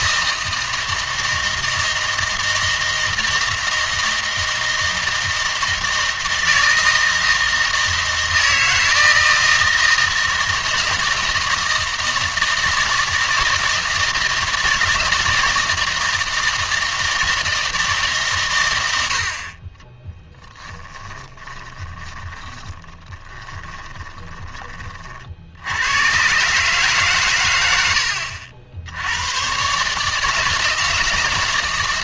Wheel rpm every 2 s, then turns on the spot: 160, 160, 160, 160, 160, 160, 160, 160, 160, 100, 20, 30, 30, 140, 80, 160.
20-24